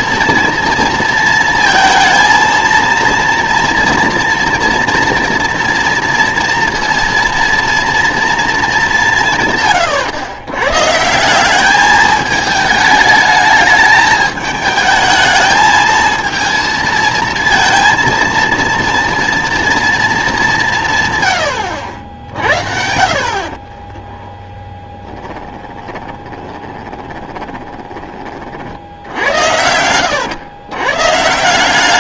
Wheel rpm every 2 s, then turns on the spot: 230, 230, 230, 230, 210, 130, 220, 220, 230, 230, 180, 60, 10, 20, 50, 120.
24-28